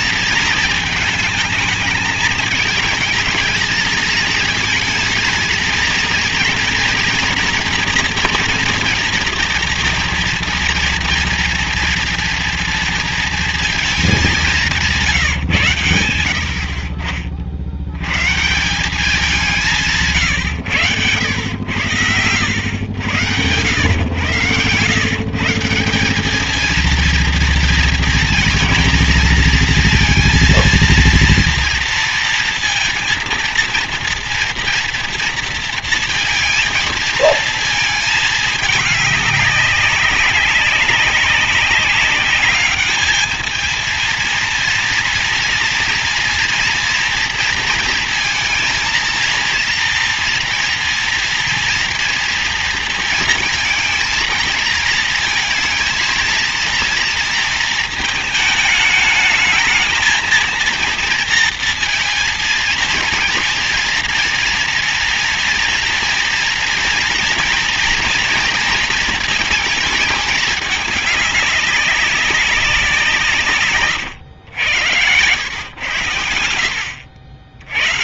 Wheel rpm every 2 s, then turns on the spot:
220, 220, 220, 230, 240, 230, 230, 190, 60, 170, 130, 100, 120, 220, 230, 230, 230, 230, 230, 210, 200, 210, 230, 230, 230, 230, 230, 230, 230, 220, 230, 230, 230, 240, 230, 210, 180, 90, 80.
none